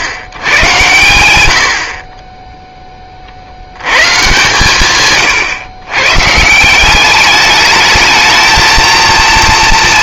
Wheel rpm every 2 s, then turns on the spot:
130, 10, 140, 170, 230.
none